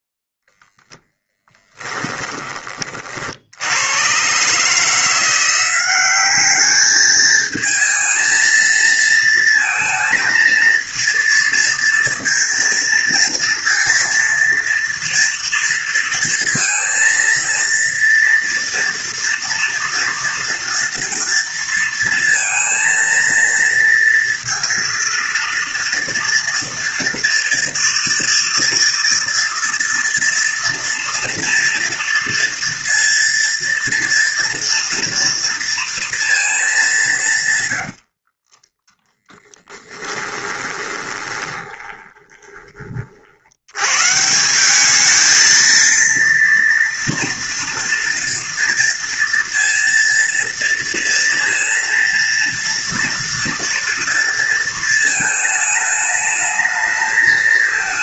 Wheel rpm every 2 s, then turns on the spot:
0, 20, 130, 200, 230, 230, 230, 230, 230, 230, 230, 230, 230, 230, 230, 230, 230, 230, 220, 30, 20, 20, 180, 240, 230, 230, 230, 230, 220.
38-44